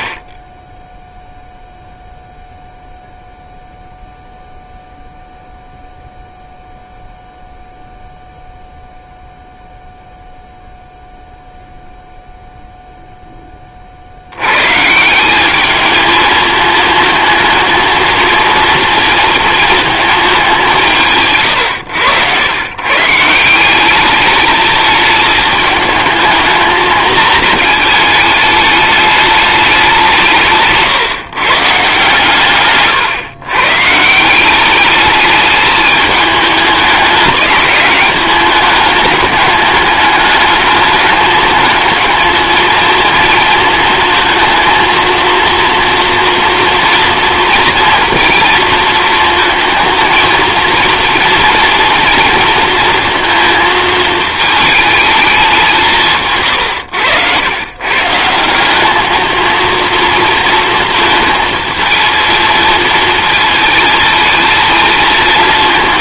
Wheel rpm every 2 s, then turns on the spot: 10, 0, 0, 0, 0, 0, 0, 130, 220, 230, 170, 120, 220, 220, 210, 150, 130, 200, 210, 210, 210, 220, 230, 230, 230, 230, 230, 220, 110, 200, 230, 230, 230.
56-58